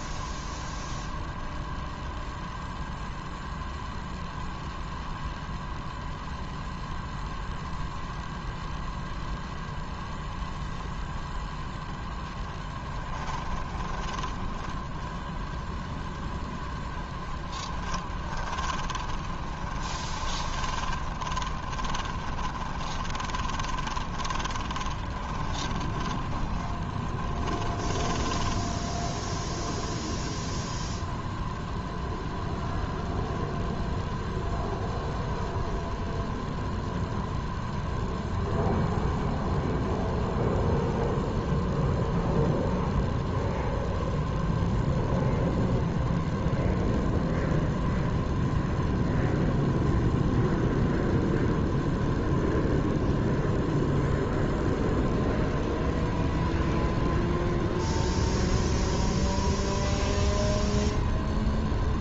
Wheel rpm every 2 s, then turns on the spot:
0, 0, 0, 0, 0, 0, 10, 10, 0, 20, 20, 20, 20, 30, 10, 0, 0, 0, 0, 0, 0, 0, 0, 0, 0, 0, 0, 0, 0, 0, 0.
12-14 18-28